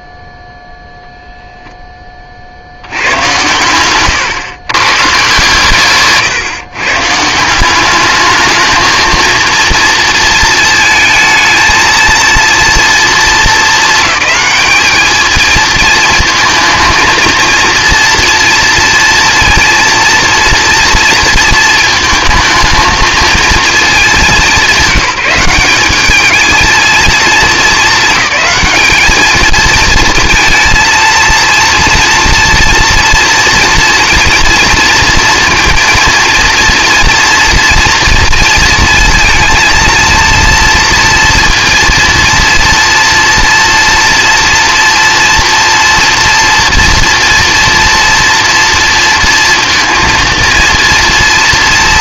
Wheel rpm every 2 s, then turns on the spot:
0, 80, 130, 120, 220, 230, 230, 210, 220, 240, 230, 220, 190, 220, 210, 230, 230, 230, 230, 230, 230, 230, 230, 230, 230, 230.
none